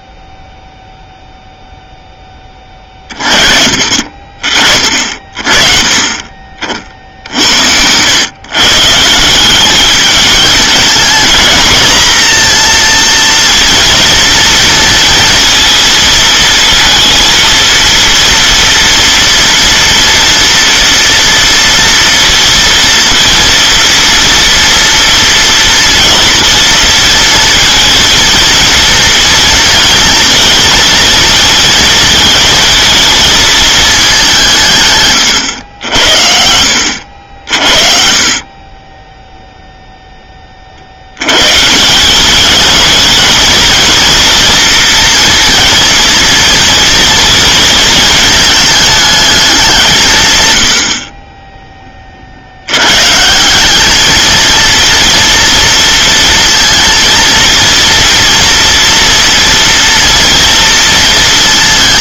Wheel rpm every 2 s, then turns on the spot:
0, 20, 40, 50, 140, 220, 230, 230, 230, 230, 230, 230, 230, 230, 230, 240, 230, 160, 80, 30, 30, 210, 230, 240, 220, 100, 90, 230, 230, 230, 230.
none